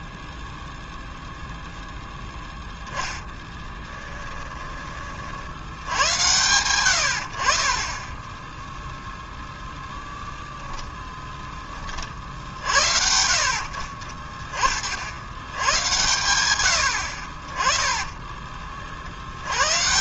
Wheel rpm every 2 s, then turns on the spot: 0, 0, 30, 90, 10, 10, 60, 60, 80, 50.
10-12 16-18